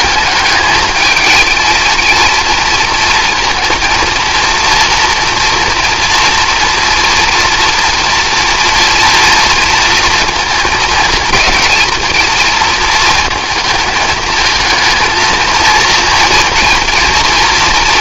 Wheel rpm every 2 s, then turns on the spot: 210, 220, 230, 230, 230, 220, 230, 220, 230.
none